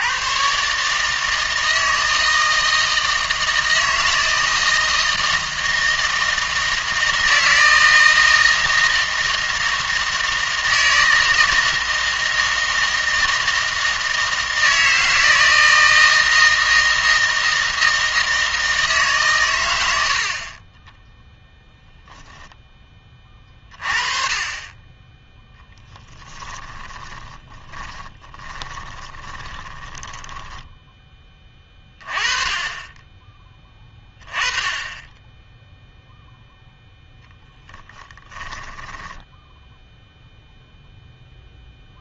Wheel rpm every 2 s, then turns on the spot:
130, 160, 160, 160, 160, 160, 160, 160, 160, 160, 30, 10, 30, 30, 20, 10, 30, 20, 0, 20, 0.
26-32 38-40